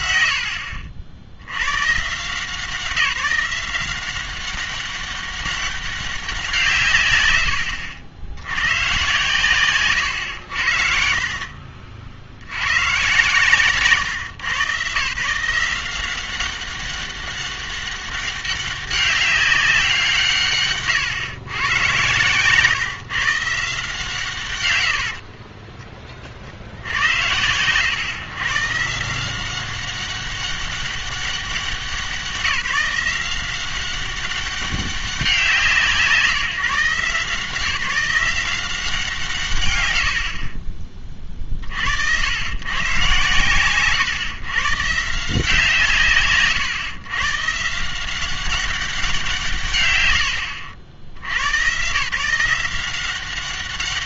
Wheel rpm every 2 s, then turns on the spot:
80, 160, 190, 150, 100, 70, 100, 140, 190, 200, 130, 130, 100, 80, 150, 200, 180, 200, 150, 170, 30, 120, 130, 130, 190, 80, 180.
24-26